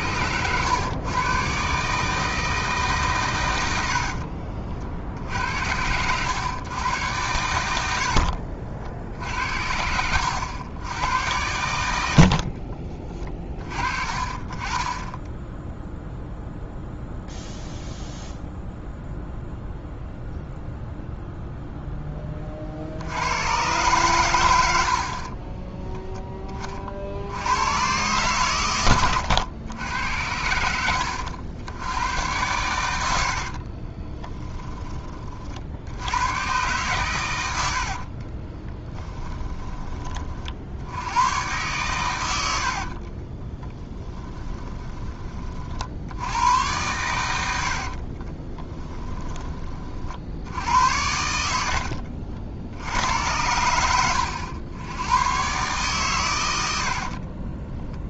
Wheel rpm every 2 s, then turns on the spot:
110, 150, 50, 110, 60, 100, 30, 20, 0, 0, 0, 60, 70, 40, 100, 90, 90, 20, 120, 20, 70, 60, 20, 110, 20, 80, 70, 100, 60.
24-26 30-32 38-40 42-44 48-50